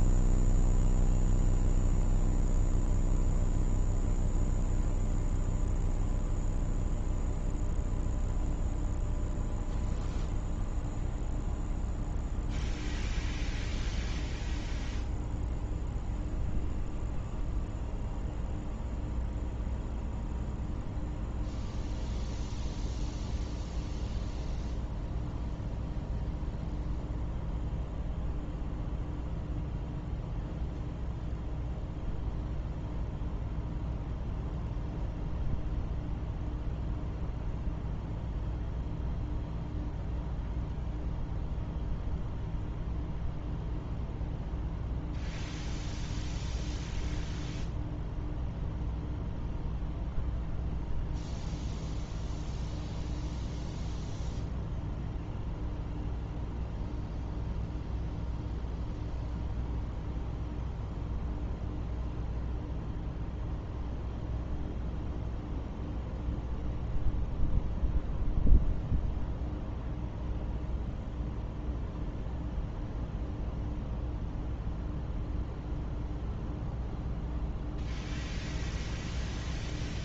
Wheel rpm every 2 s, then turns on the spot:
0, 0, 0, 0, 0, 0, 0, 0, 0, 0, 0, 0, 0, 0, 0, 0, 0, 0, 0, 0, 0, 0, 0, 0, 0, 0, 0, 0, 0, 0, 0, 0, 0, 0, 0, 0, 0, 0, 0, 0.
none